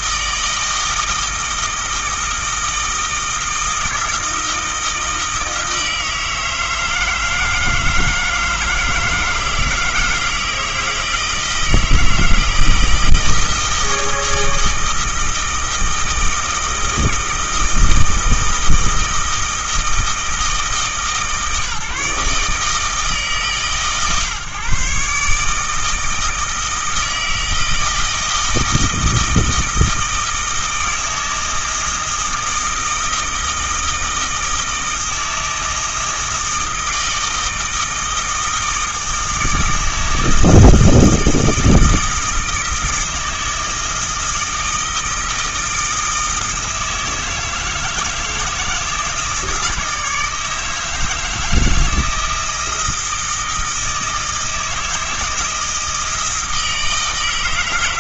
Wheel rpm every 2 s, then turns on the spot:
160, 160, 160, 160, 160, 160, 160, 160, 160, 160, 150, 150, 140, 160, 160, 160, 160, 160, 160, 160, 160, 160, 160, 160, 160, 160, 160, 160, 160.
none